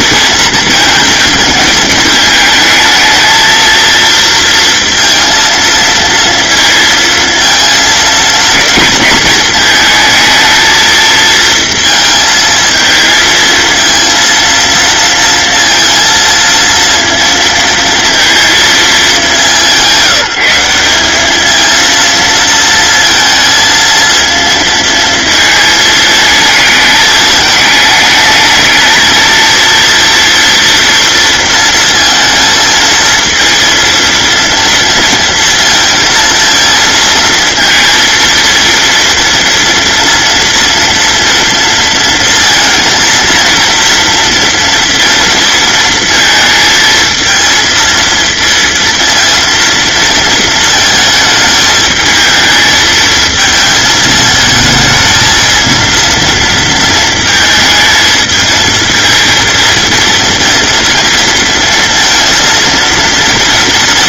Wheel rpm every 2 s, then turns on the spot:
230, 220, 230, 230, 220, 220, 220, 230, 230, 220, 180, 230, 230, 220, 220, 230, 230, 230, 230, 230, 230, 230, 230, 220, 230, 230, 220, 220, 230, 220, 230, 230.
none